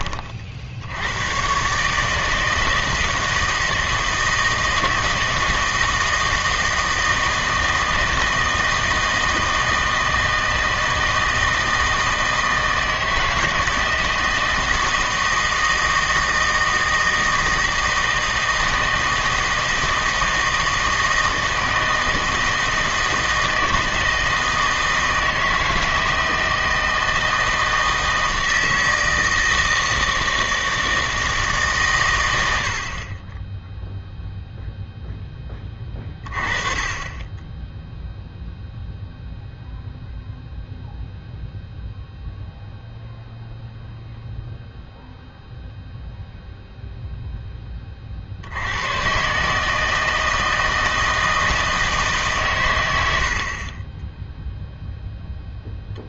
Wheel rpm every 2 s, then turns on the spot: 60, 160, 160, 160, 160, 160, 160, 160, 160, 160, 160, 160, 160, 160, 160, 160, 70, 0, 30, 0, 0, 0, 0, 0, 90, 160, 110, 0.
none